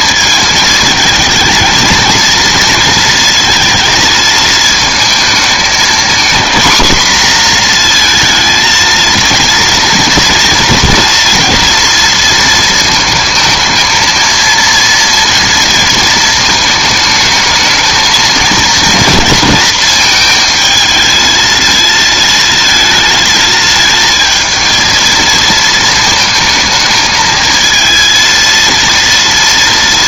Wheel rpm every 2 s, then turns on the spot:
220, 230, 220, 230, 230, 240, 230, 230, 220, 220, 220, 220, 220, 220, 230.
none